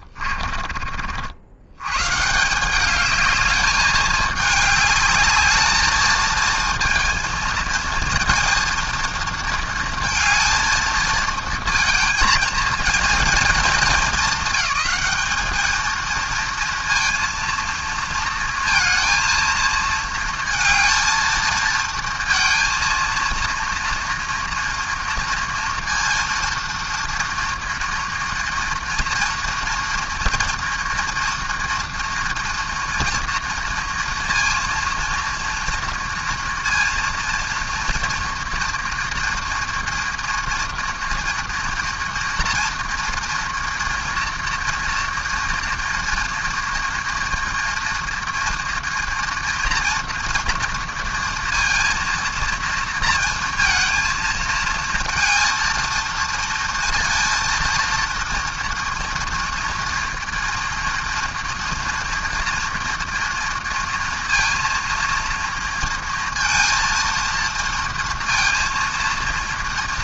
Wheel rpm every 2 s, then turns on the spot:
40, 200, 210, 230, 230, 220, 230, 200, 230, 230, 230, 230, 230, 230, 230, 230, 230, 230, 230, 230, 230, 230, 240, 240, 230, 230, 230, 230, 230, 230, 230, 230, 230, 230, 230.
none